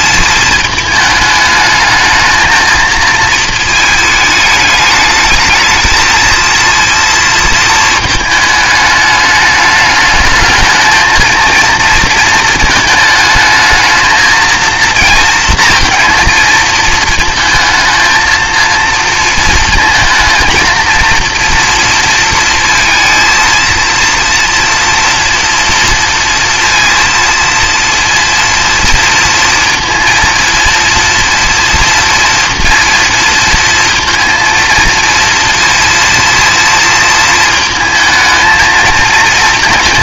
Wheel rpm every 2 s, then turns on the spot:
220, 230, 210, 230, 210, 220, 220, 220, 220, 230, 230, 230, 230, 230, 230, 230, 230, 230, 230, 220.
none